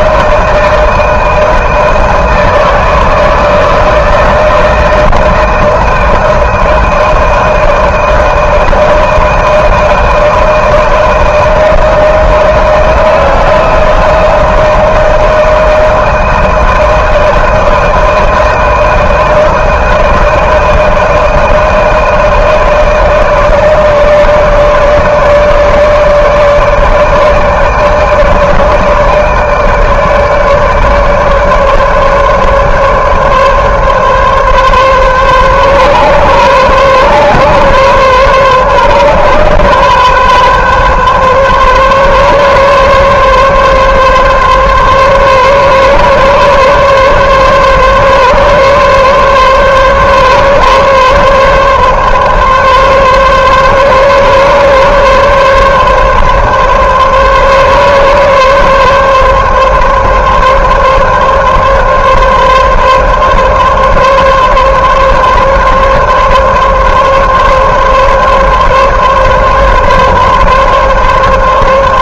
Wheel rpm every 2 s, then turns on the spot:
160, 160, 160, 160, 160, 160, 160, 160, 160, 160, 160, 160, 160, 150, 160, 150, 150, 140, 130, 130, 130, 140, 140, 140, 140, 140, 140, 140, 140, 140, 140, 140, 140, 140, 140, 140.
none